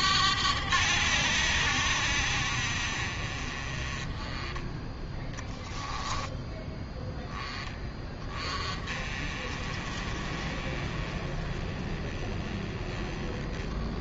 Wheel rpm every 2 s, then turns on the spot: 90, 50, 10, 10, 30, 30, 20.
none